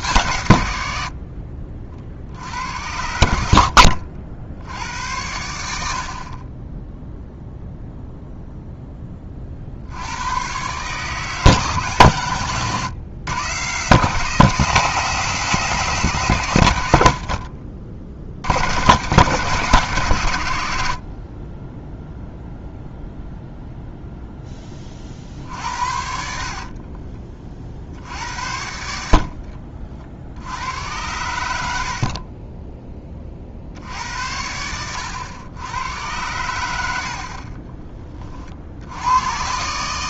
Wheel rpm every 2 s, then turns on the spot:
90, 80, 90, 10, 10, 140, 130, 170, 100, 110, 60, 0, 30, 40, 70, 80, 20, 90, 80, 80.
26-28